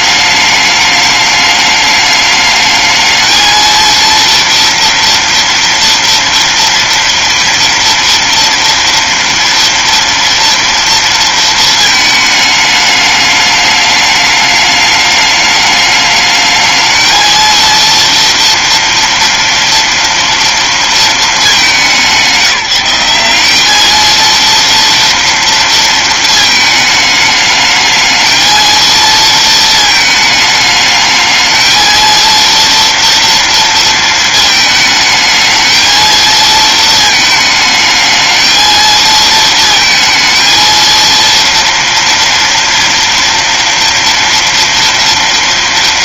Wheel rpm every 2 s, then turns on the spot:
210, 220, 230, 240, 230, 230, 210, 210, 230, 230, 200, 190, 230, 210, 230, 220, 230, 220, 220, 230, 230, 230, 230.
none